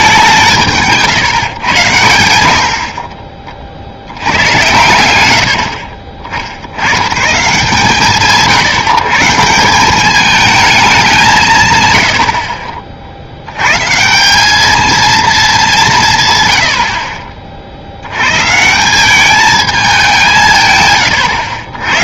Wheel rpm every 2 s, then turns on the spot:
160, 60, 110, 70, 150, 220, 40, 210, 100, 150, 150.
none